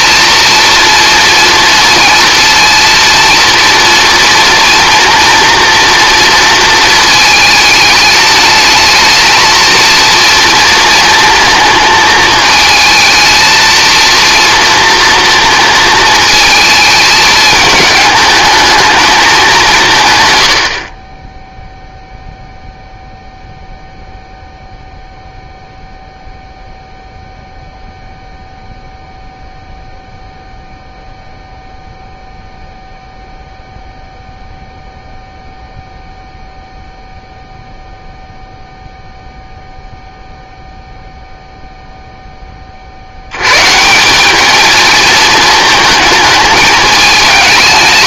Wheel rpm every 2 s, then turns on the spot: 230, 230, 230, 230, 220, 230, 220, 230, 210, 220, 50, 0, 0, 0, 0, 0, 0, 0, 0, 0, 0, 50, 220, 220.
none